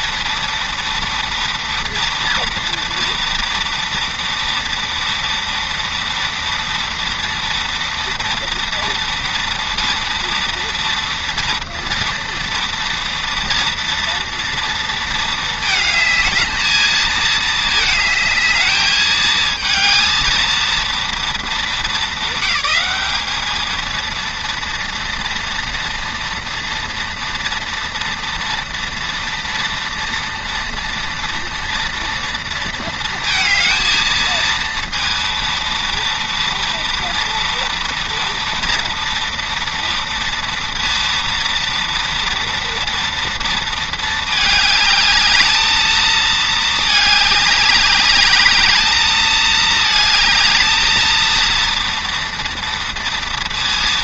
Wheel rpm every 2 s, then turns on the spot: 230, 230, 230, 230, 230, 230, 230, 230, 220, 220, 230, 200, 230, 230, 230, 230, 230, 230, 230, 230, 230, 230, 220, 220, 210, 220, 230.
none